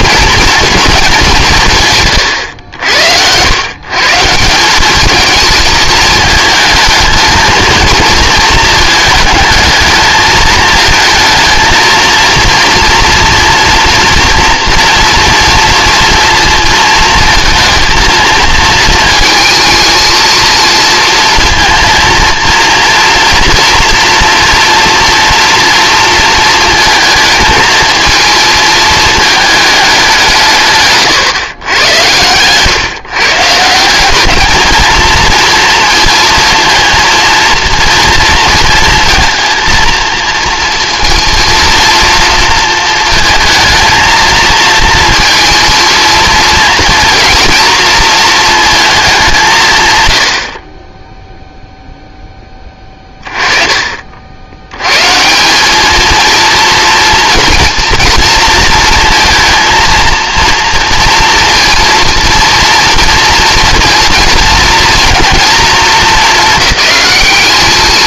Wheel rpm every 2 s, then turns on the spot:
220, 90, 200, 220, 220, 220, 240, 230, 230, 230, 230, 240, 240, 220, 220, 150, 140, 220, 230, 230, 230, 220, 230, 230, 220, 40, 20, 100, 230, 230, 230, 230, 230, 210.
none